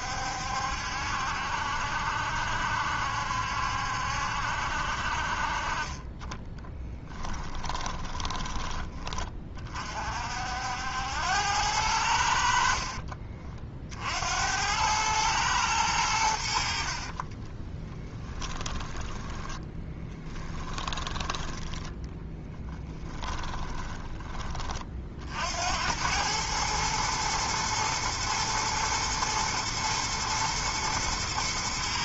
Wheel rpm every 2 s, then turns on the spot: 70, 70, 60, 10, 20, 80, 60, 100, 50, 10, 20, 10, 40, 110, 120, 120.
6-8 12-14 16-24